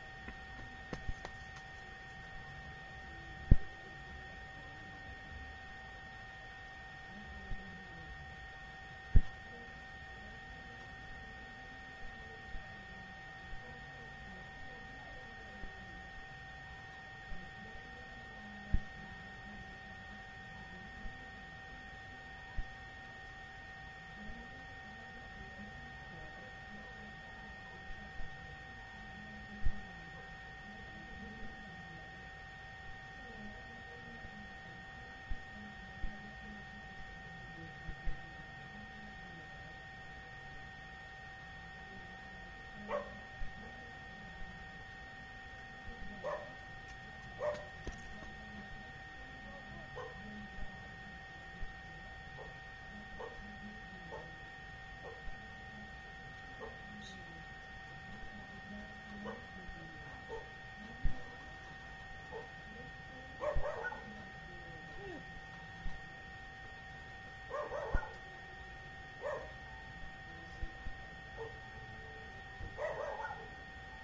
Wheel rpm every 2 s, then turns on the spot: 0, 0, 0, 0, 0, 0, 0, 0, 0, 0, 0, 0, 0, 0, 0, 0, 0, 0, 0, 0, 0, 0, 0, 0, 0, 0, 0, 0, 0, 0, 0, 0, 0, 0, 0, 0, 0.
none